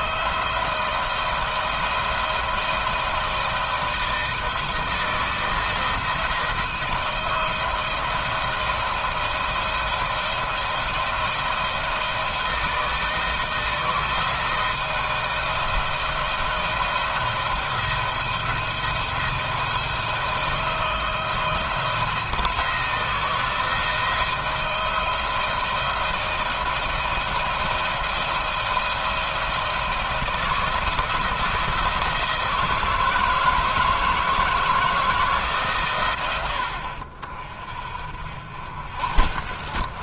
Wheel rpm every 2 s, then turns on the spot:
160, 170, 160, 170, 170, 170, 160, 160, 170, 170, 170, 160, 160, 170, 170, 160, 160, 160, 80, 60.
none